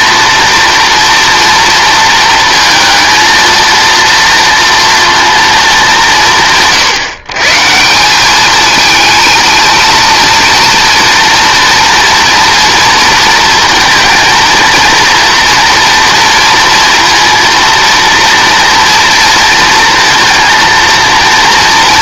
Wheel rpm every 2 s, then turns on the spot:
230, 230, 230, 150, 220, 230, 240, 230, 230, 230, 230.
none